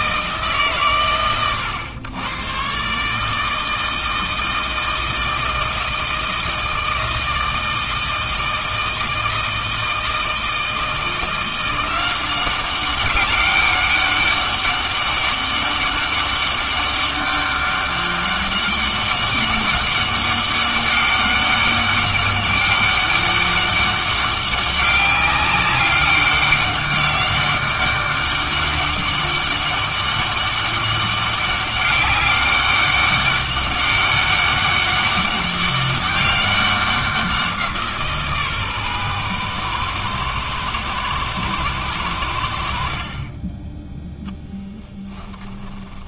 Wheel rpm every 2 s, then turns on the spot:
120, 120, 160, 160, 160, 160, 190, 200, 200, 200, 200, 200, 200, 200, 200, 200, 200, 200, 190, 130, 110, 70, 10.
44-46